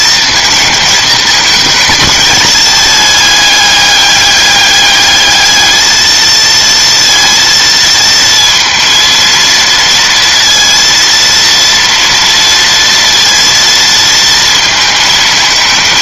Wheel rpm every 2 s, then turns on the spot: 230, 210, 210, 230, 230, 230, 230, 220.
none